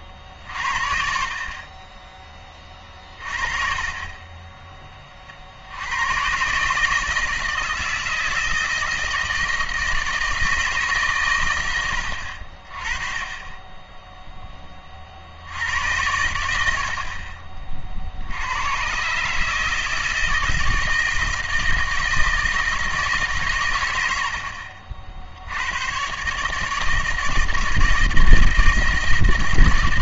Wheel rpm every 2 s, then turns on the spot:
50, 40, 20, 150, 160, 150, 30, 40, 50, 110, 160, 160, 60, 160, 160.
none